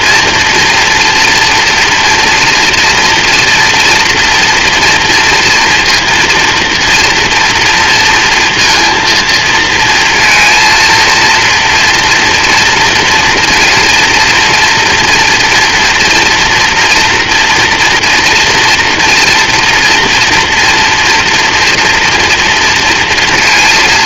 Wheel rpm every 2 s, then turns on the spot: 230, 230, 240, 230, 230, 230, 230, 230, 230, 230, 240, 240.
none